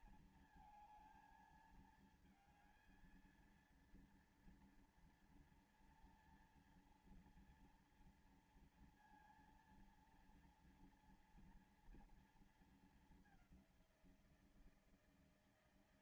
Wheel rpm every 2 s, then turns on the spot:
220, 230, 230, 230, 230, 230, 230, 180.
none